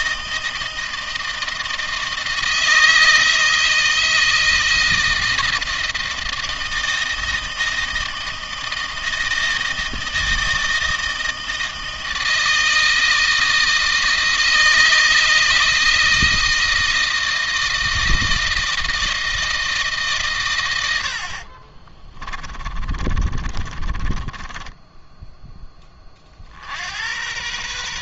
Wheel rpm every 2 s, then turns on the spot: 160, 160, 160, 160, 160, 160, 160, 160, 160, 160, 100, 40, 10, 80.
20-26